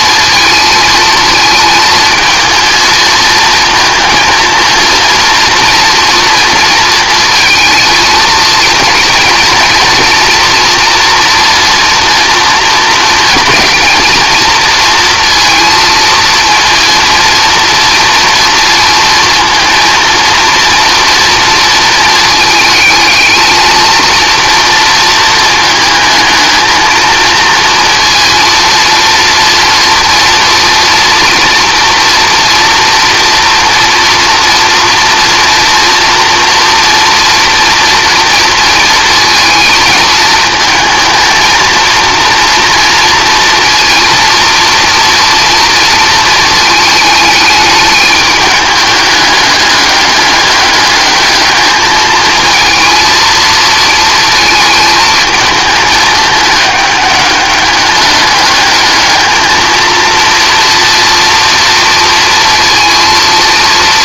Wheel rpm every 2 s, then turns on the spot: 220, 230, 230, 220, 230, 240, 230, 230, 230, 230, 230, 220, 230, 220, 230, 230, 240, 230, 230, 230, 220, 230, 230, 220, 210, 210, 230, 220, 200, 210, 230, 230.
none